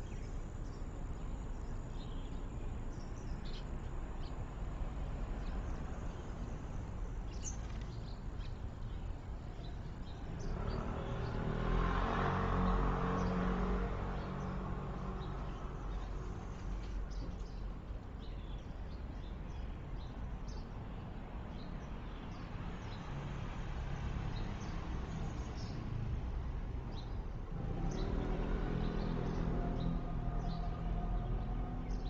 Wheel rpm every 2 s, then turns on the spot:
0, 0, 0, 0, 0, 0, 0, 0, 0, 0, 0, 0, 0, 0, 0, 0.
none